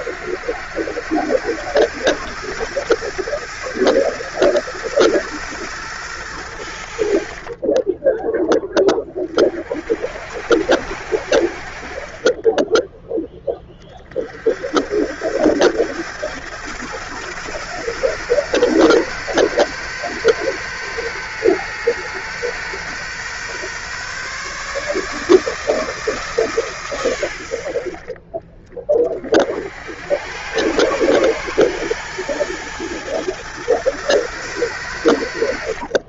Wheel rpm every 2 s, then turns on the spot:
90, 100, 110, 90, 10, 80, 20, 60, 110, 120, 120, 120, 140, 140, 20, 110, 110, 110.
none